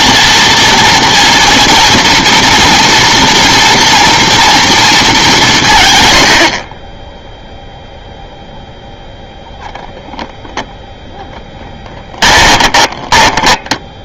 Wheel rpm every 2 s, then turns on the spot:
230, 230, 230, 60, 0, 0, 10.
12-14